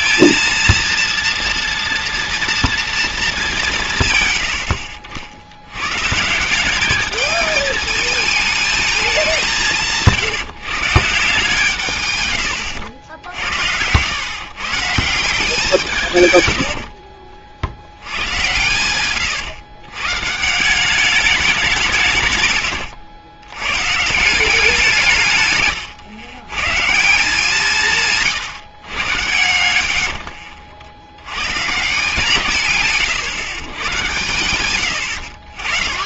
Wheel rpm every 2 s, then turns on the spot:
230, 230, 80, 180, 220, 150, 110, 130, 100, 100, 160, 110, 170, 130, 140, 50, 160, 110.
12-14 16-18 22-24 34-36